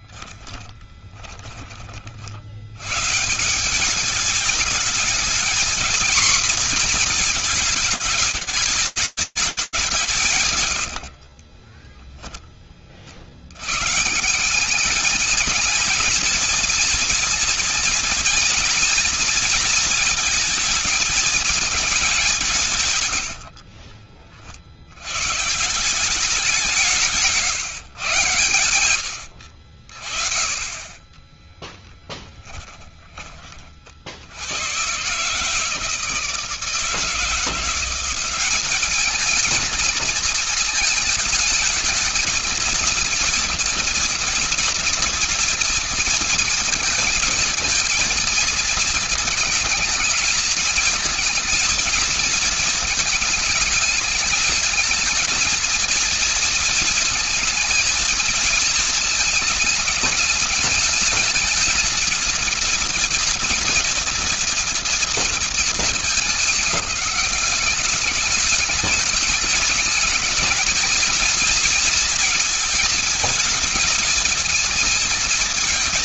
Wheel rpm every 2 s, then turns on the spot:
20, 110, 220, 230, 210, 130, 30, 200, 230, 240, 230, 160, 90, 170, 100, 20, 30, 140, 170, 210, 220, 230, 230, 220, 220, 220, 220, 220, 230, 220, 210, 230, 230, 200, 210, 210, 220, 220.
0-2 10-12 28-30